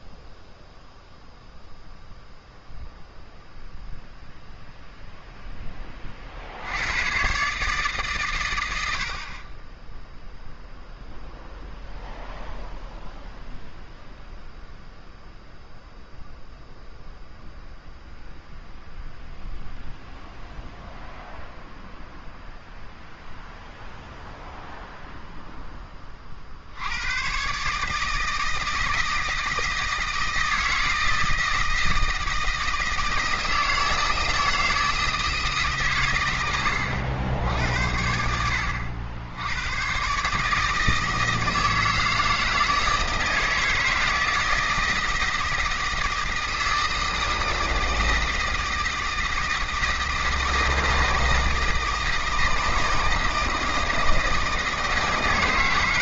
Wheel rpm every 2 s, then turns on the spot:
0, 0, 0, 90, 90, 0, 0, 0, 0, 0, 0, 0, 0, 80, 160, 160, 160, 160, 100, 90, 160, 160, 160, 160, 160, 160, 160, 160.
none